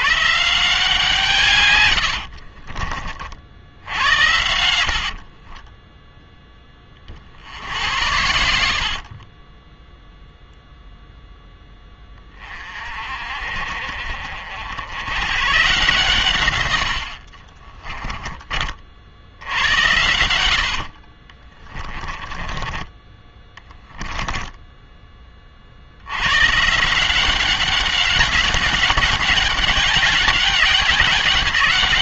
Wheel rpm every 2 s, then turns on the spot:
160, 40, 70, 20, 70, 0, 40, 80, 100, 50, 60, 20, 10, 160, 200, 200.
2-6 8-10 16-18 20-26